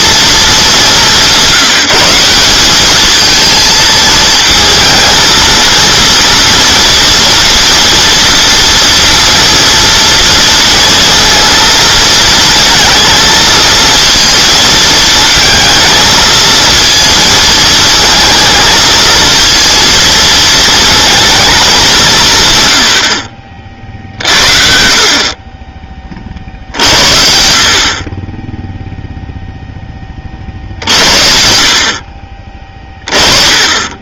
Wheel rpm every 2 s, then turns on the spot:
210, 190, 220, 230, 230, 230, 230, 230, 230, 220, 220, 110, 50, 70, 0, 70, 30.
none